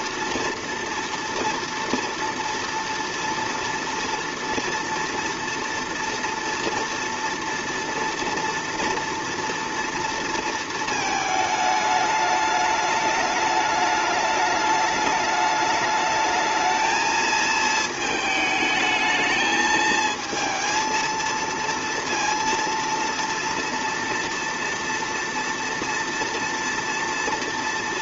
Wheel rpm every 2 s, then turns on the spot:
230, 230, 230, 230, 230, 230, 210, 210, 220, 220, 230, 230, 230, 230.
none